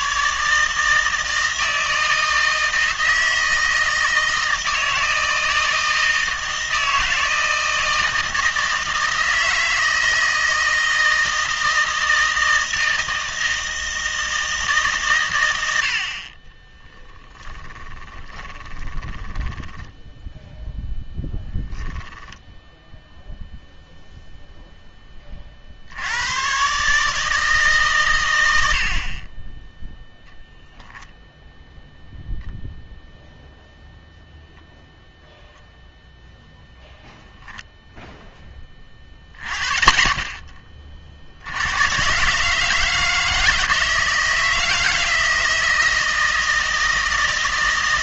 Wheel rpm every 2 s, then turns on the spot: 150, 160, 160, 160, 160, 160, 160, 150, 20, 20, 0, 10, 0, 130, 70, 0, 0, 0, 0, 20, 30, 160, 160, 160.
16-20 22-24